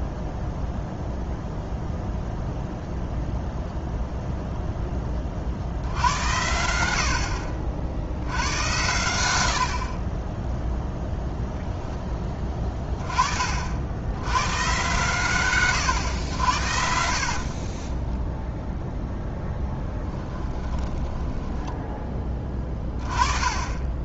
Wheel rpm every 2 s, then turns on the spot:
0, 0, 0, 90, 100, 0, 20, 120, 80, 0, 20, 20.
20-22